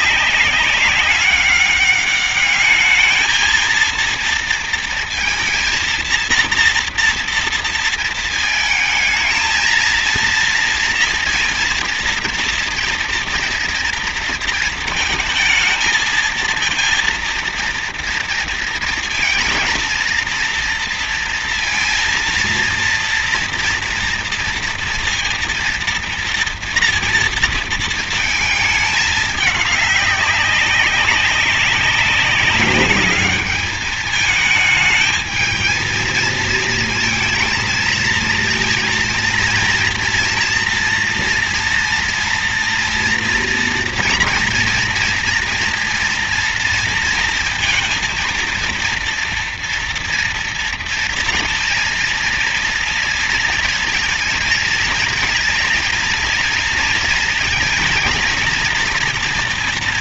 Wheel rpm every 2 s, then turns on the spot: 200, 210, 230, 240, 220, 230, 230, 230, 230, 230, 230, 230, 230, 230, 210, 200, 200, 220, 230, 230, 230, 230, 230, 230, 230, 230, 230, 220, 230, 240.
none